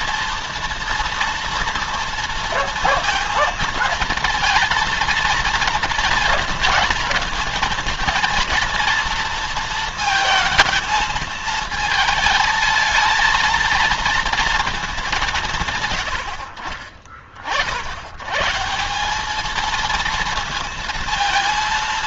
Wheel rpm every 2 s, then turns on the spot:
230, 230, 230, 220, 230, 220, 220, 220, 50, 190, 230.
none